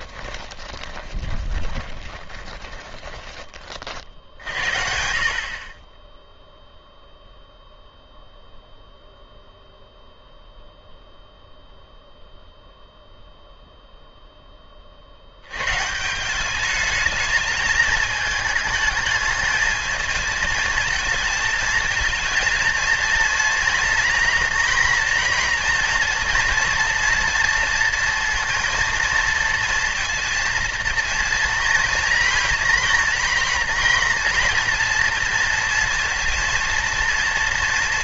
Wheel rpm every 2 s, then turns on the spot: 20, 20, 60, 0, 0, 0, 0, 30, 210, 220, 230, 230, 240, 230, 230, 230, 230, 230, 230.
0-4